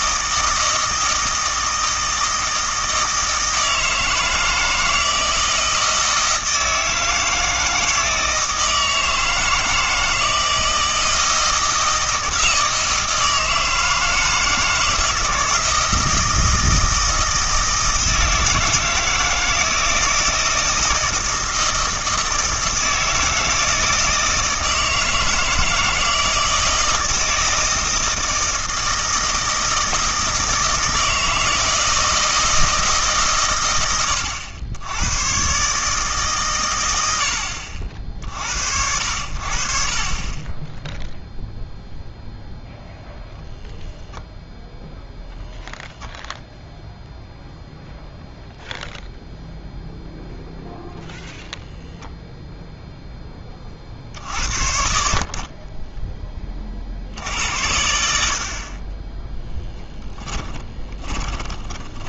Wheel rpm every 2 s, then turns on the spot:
160, 160, 160, 160, 160, 160, 160, 160, 160, 160, 160, 160, 160, 160, 160, 160, 160, 90, 120, 70, 10, 0, 0, 0, 0, 0, 0, 60, 50, 30, 20.
40-42 60-62